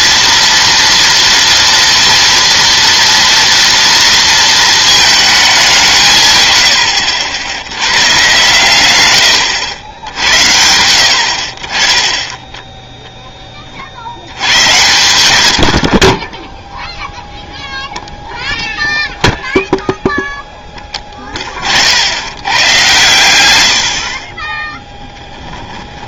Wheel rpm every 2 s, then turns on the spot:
230, 230, 220, 110, 120, 80, 10, 100, 0, 0, 10, 110, 10.
24-26